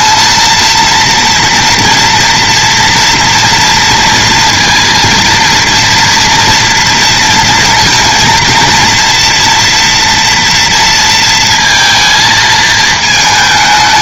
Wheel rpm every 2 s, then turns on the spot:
230, 230, 230, 230, 230, 230, 220.
none